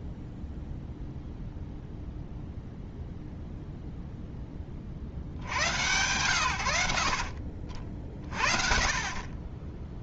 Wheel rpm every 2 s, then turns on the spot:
0, 0, 30, 80, 40.
none